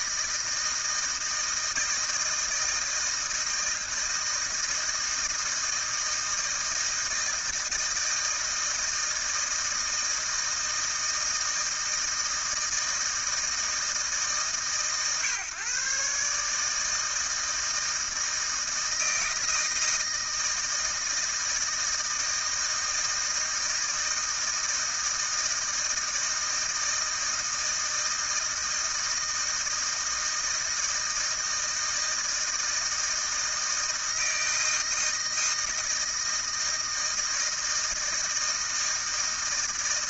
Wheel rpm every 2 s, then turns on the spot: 160, 160, 160, 160, 160, 160, 160, 140, 150, 160, 160, 160, 160, 160, 160, 160, 160, 160, 160, 160.
none